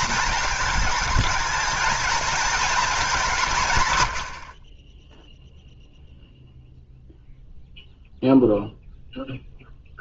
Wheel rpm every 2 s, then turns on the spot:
220, 220, 40, 0, 0.
none